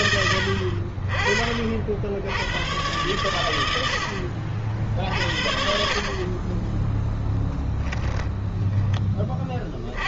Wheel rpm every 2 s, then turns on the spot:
50, 100, 70, 10, 30.
none